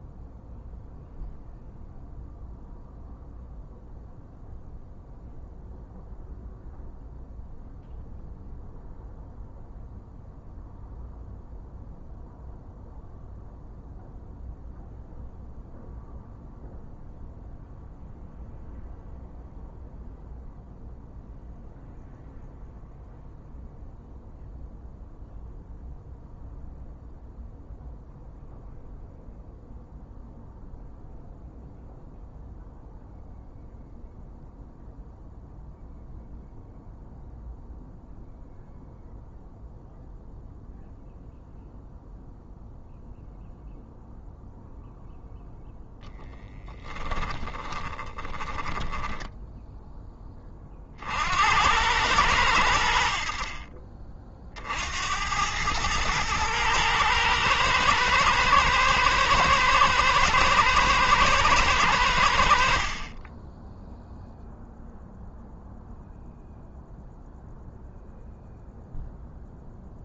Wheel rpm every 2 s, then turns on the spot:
0, 0, 0, 0, 0, 0, 0, 0, 0, 0, 0, 0, 0, 0, 0, 0, 0, 0, 0, 0, 0, 0, 0, 20, 10, 50, 80, 80, 110, 120, 110, 30, 0, 0, 0.
46-50